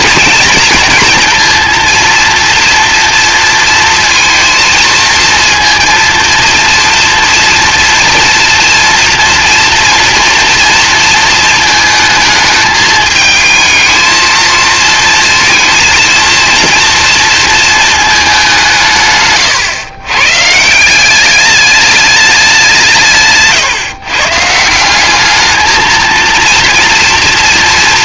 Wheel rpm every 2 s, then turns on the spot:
230, 230, 230, 230, 240, 230, 220, 220, 230, 160, 170, 170, 190, 230.
none